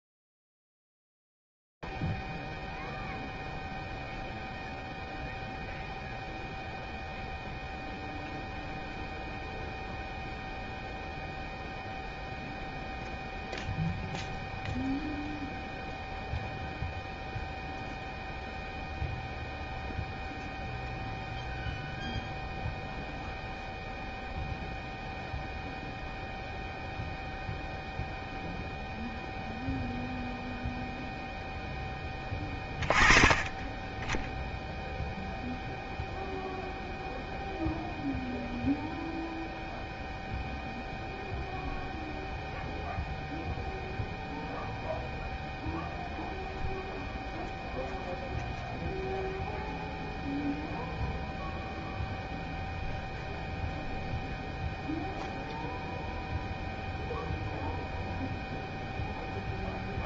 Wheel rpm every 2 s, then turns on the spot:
0, 0, 0, 0, 0, 0, 0, 0, 0, 0, 0, 0, 0, 0, 0, 0, 20, 0, 0, 0, 0, 0, 0, 0, 0, 0, 0, 0, 0, 0.
none